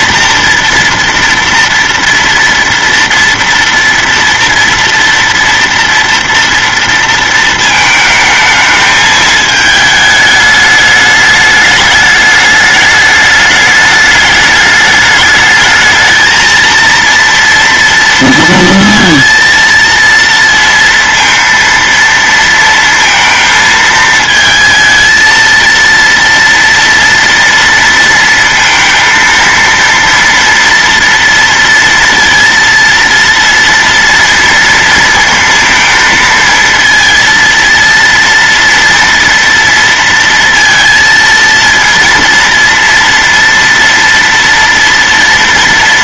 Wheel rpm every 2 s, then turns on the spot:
230, 230, 230, 230, 220, 210, 210, 210, 230, 230, 230, 230, 220, 230, 230, 230, 230, 230, 220, 230, 230, 230, 230.
none